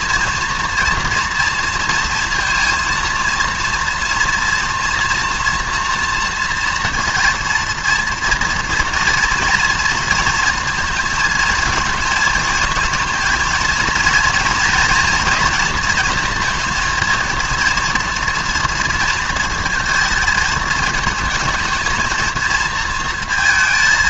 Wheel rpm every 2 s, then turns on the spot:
230, 230, 230, 230, 230, 230, 230, 230, 220, 230, 220, 230.
none